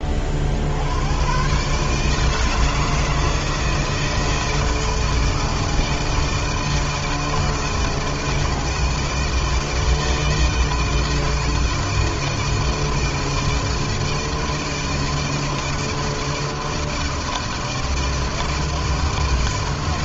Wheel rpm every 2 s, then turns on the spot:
100, 160, 160, 160, 160, 160, 160, 160, 160, 160.
none